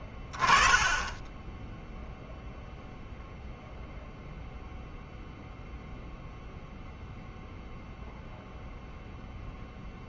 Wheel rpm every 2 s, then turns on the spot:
10, 0, 0, 0, 0.
none